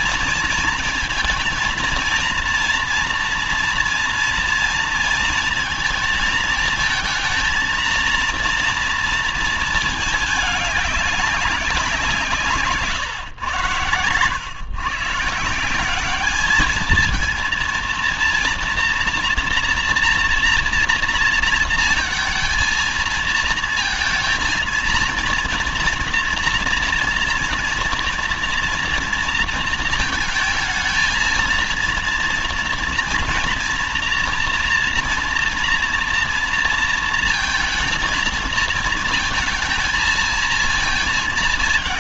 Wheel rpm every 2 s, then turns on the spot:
230, 230, 230, 220, 230, 210, 160, 120, 210, 230, 230, 230, 230, 240, 230, 220, 230, 230, 230, 230, 230.
none